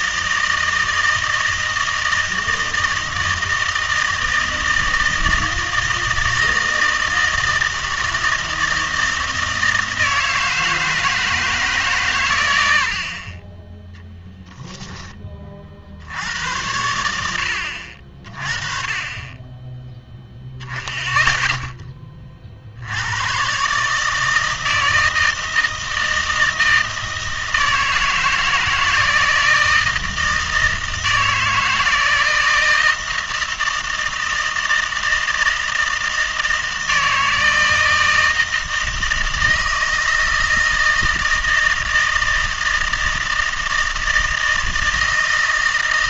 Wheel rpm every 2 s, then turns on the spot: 160, 160, 160, 160, 160, 160, 80, 10, 80, 30, 0, 60, 160, 160, 160, 160, 160, 160, 160, 160, 160, 160, 160.
14-16